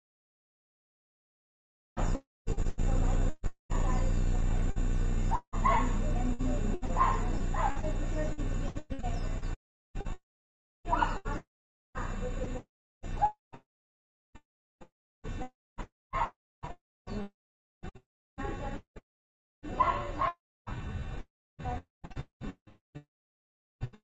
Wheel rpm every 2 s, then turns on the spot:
0, 0, 0, 0, 0, 0, 0, 0, 0, 0, 0, 0.
none